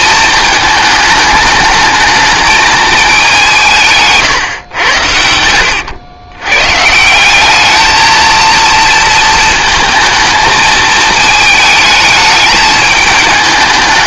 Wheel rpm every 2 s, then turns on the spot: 210, 220, 90, 140, 230, 220, 210.
none